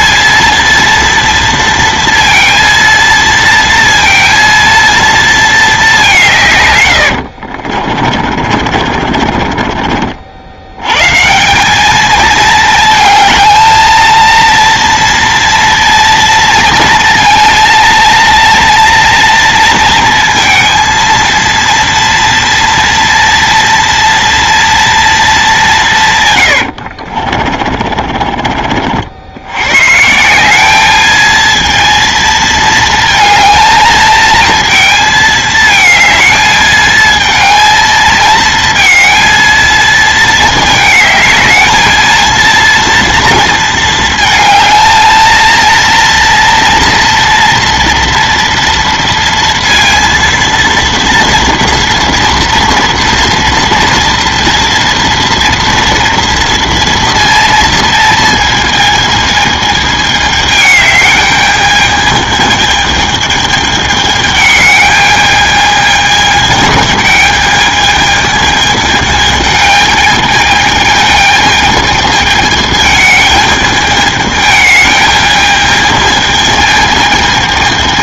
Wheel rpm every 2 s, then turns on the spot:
230, 230, 230, 90, 40, 110, 220, 230, 230, 230, 230, 230, 230, 70, 50, 210, 230, 220, 220, 230, 220, 230, 220, 230, 230, 230, 230, 230, 230, 220, 210, 220, 210, 220, 210, 220, 210, 210, 220.
6-10 26-28